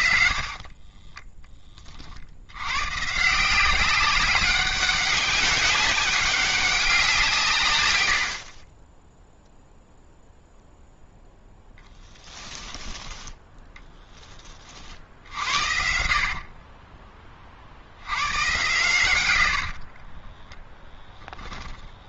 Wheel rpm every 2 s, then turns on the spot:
40, 110, 190, 190, 30, 0, 10, 30, 50, 110, 10.
0-2 12-14 20-22